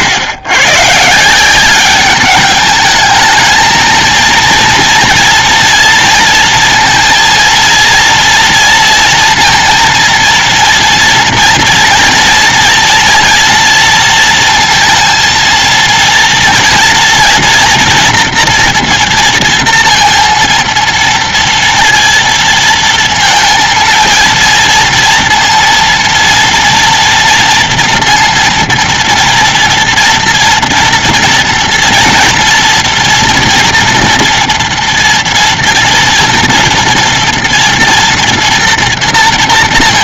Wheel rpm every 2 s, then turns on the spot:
90, 200, 230, 230, 230, 230, 230, 230, 230, 230, 230, 230, 220, 230, 230, 230, 230, 230, 240, 240.
none